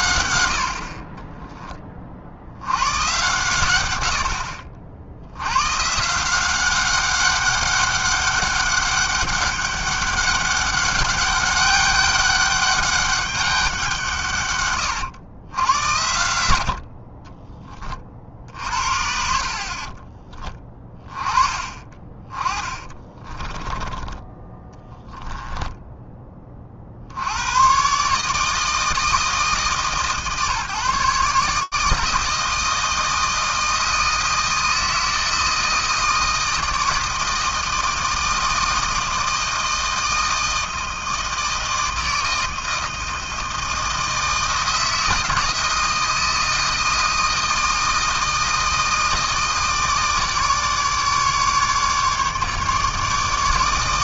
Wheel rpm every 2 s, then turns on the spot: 80, 80, 60, 180, 200, 200, 200, 140, 80, 60, 20, 20, 10, 30, 150, 150, 160, 160, 160, 160, 160, 160, 160, 160, 160, 150, 150.
22-24